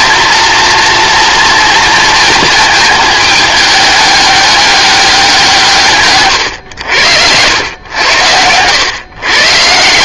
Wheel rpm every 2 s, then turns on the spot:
230, 220, 200, 100, 110.
none